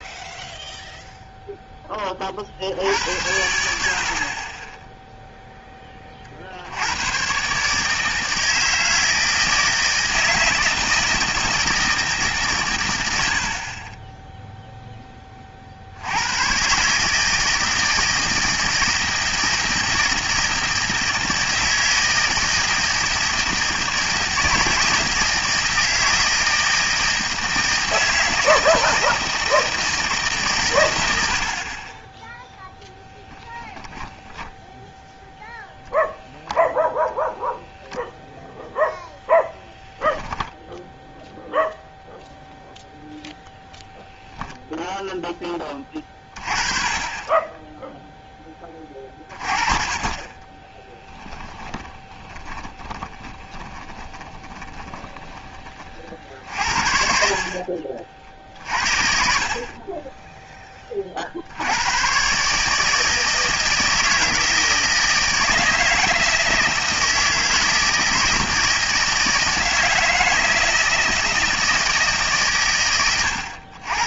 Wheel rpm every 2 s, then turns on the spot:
0, 60, 10, 70, 160, 160, 120, 0, 130, 160, 160, 160, 160, 160, 160, 130, 0, 10, 0, 0, 0, 0, 0, 30, 20, 20, 20, 20, 60, 50, 20, 150, 160, 160, 160, 160, 120.
50-56